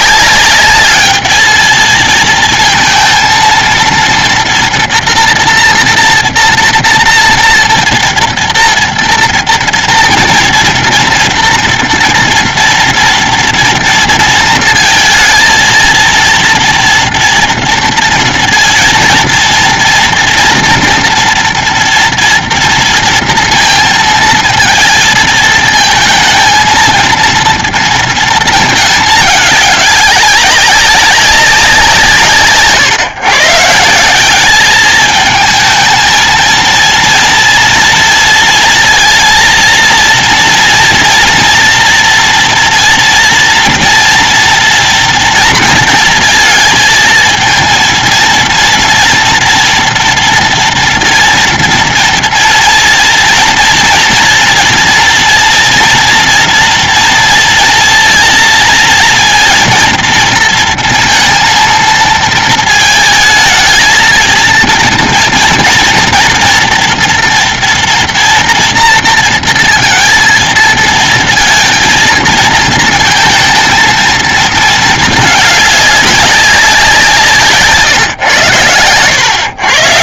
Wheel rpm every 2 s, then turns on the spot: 210, 220, 230, 230, 230, 240, 230, 230, 240, 230, 230, 230, 220, 230, 210, 200, 140, 210, 230, 230, 230, 230, 230, 230, 230, 230, 230, 230, 230, 230, 230, 220, 230, 240, 230, 230, 230, 220, 180, 110.
none